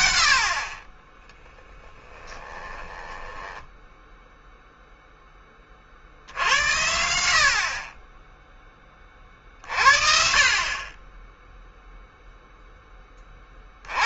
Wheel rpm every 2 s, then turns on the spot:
50, 20, 0, 70, 20, 30, 10.
2-4